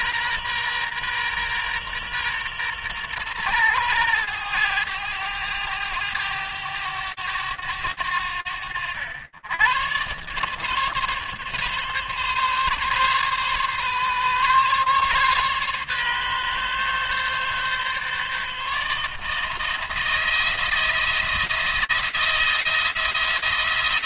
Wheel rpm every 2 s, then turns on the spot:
120, 120, 110, 100, 90, 140, 140, 140, 130, 150, 170, 170.
none